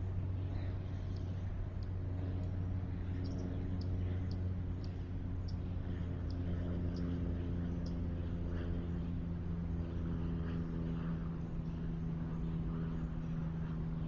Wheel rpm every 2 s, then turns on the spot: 0, 0, 0, 0, 0, 0, 0.
none